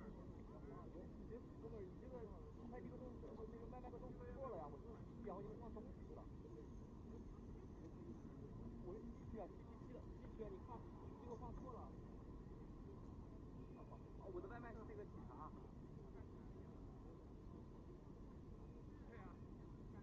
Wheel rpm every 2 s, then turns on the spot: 0, 0, 0, 0, 0, 0, 0, 0, 0, 0.
none